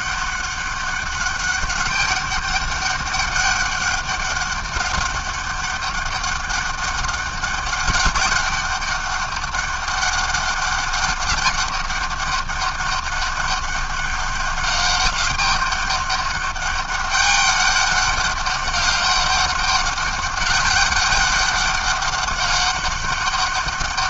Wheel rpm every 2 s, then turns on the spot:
200, 200, 200, 200, 200, 200, 200, 200, 200, 200, 200, 200.
none